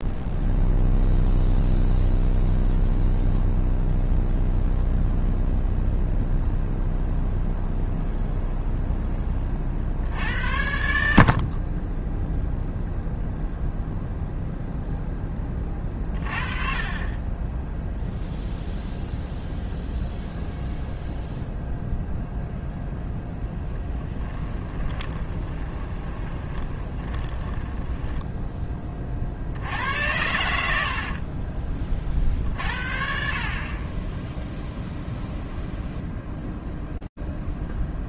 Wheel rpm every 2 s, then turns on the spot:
0, 0, 0, 0, 0, 70, 0, 0, 40, 0, 0, 0, 20, 20, 20, 70, 50, 0, 0.
24-28